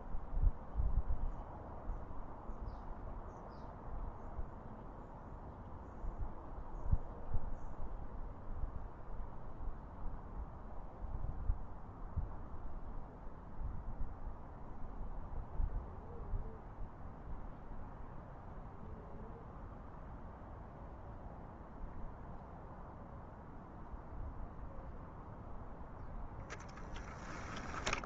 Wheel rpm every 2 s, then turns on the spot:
0, 0, 0, 0, 0, 0, 0, 0, 0, 0, 0, 0, 0, 10.
none